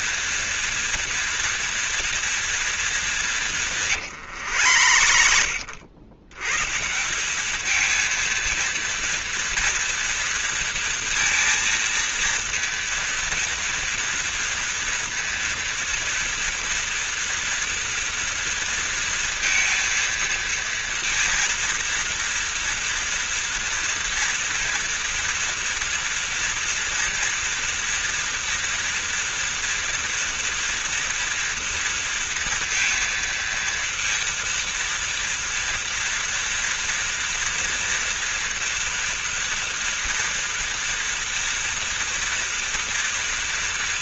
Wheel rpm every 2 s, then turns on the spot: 230, 230, 110, 110, 230, 230, 230, 230, 230, 230, 230, 230, 230, 240, 230, 240, 230, 230, 230, 230, 230, 230.
4-6